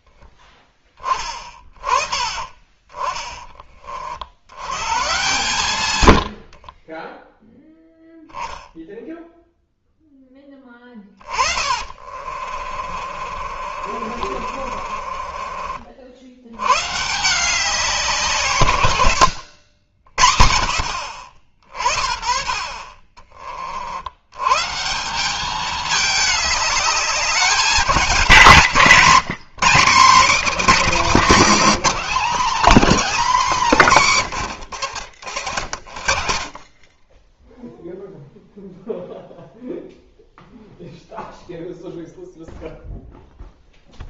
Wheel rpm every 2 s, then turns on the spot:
20, 20, 100, 40, 0, 20, 40, 40, 110, 130, 60, 40, 130, 210, 170, 220, 260, 110, 30, 0, 0, 0.
6-8 10-16